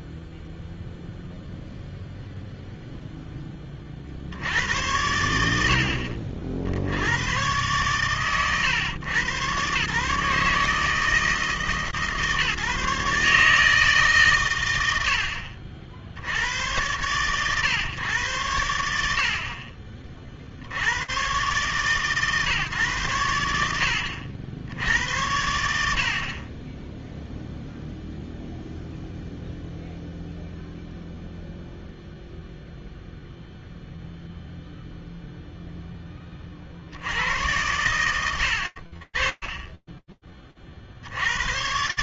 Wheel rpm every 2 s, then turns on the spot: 0, 30, 80, 120, 120, 150, 150, 80, 110, 70, 120, 110, 80, 0, 0, 0, 0, 0, 90, 40, 60.
none